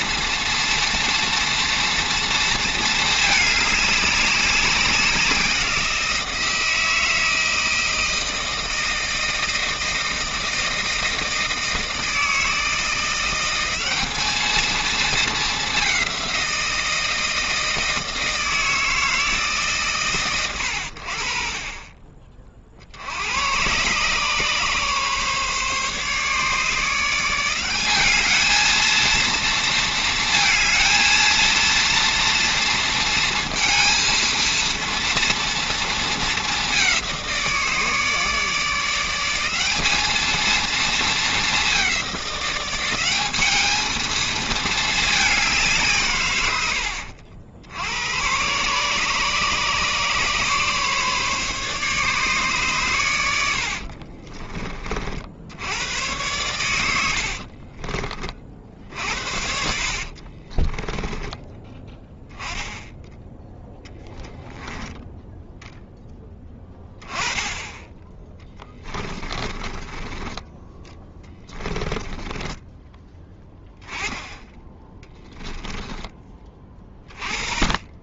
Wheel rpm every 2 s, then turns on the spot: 230, 220, 190, 160, 160, 160, 170, 220, 170, 160, 80, 70, 140, 160, 220, 230, 230, 230, 200, 170, 220, 190, 220, 80, 140, 140, 120, 40, 90, 60, 30, 10, 10, 20, 20, 10, 10, 10, 30.
60-62 68-70 74-76